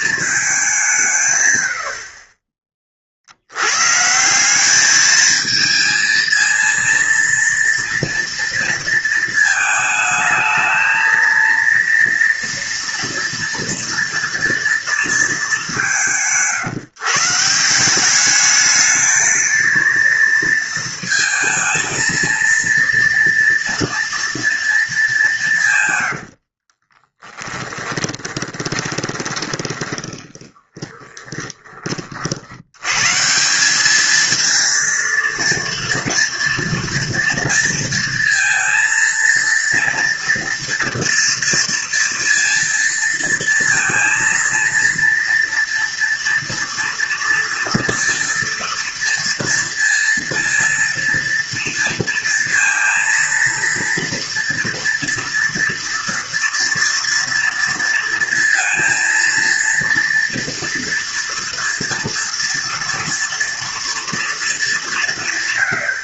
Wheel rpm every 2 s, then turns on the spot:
210, 40, 190, 230, 230, 220, 230, 230, 160, 210, 230, 230, 230, 60, 20, 20, 80, 220, 230, 230, 240, 230, 230, 230, 230, 230, 230, 230, 230, 230, 230, 240, 220.
26-32